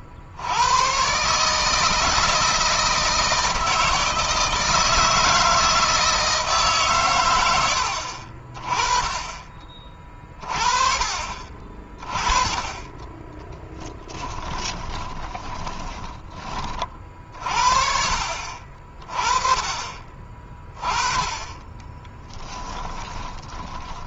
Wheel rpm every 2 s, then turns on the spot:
100, 160, 160, 140, 40, 40, 10, 30, 40, 40, 20, 20.
14-16 22-24